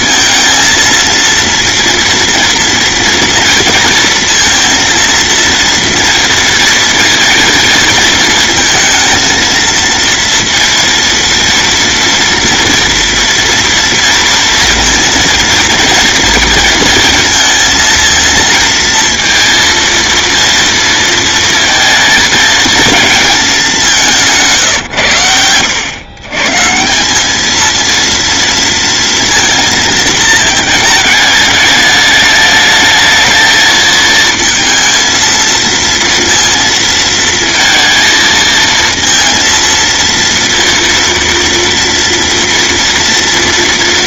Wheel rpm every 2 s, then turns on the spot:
230, 230, 230, 230, 220, 230, 230, 230, 230, 230, 230, 220, 140, 140, 230, 220, 220, 230, 230, 230, 230, 230.
none